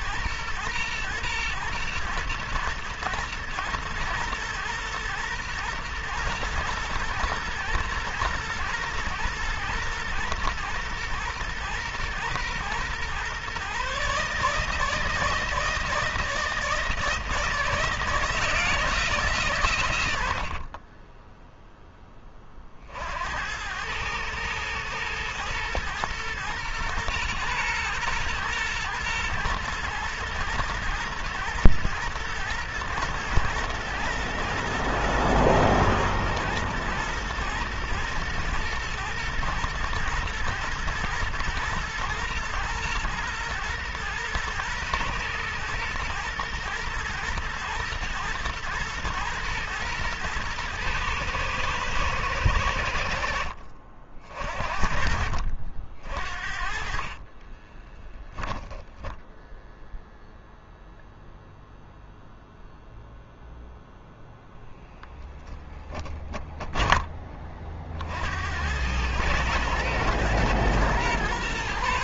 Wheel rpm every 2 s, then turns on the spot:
120, 120, 120, 120, 110, 120, 130, 160, 160, 150, 20, 70, 110, 120, 110, 110, 110, 110, 120, 120, 120, 120, 120, 110, 110, 110, 70, 60, 30, 0, 0, 0, 0, 30, 100, 120.
20-22 56-58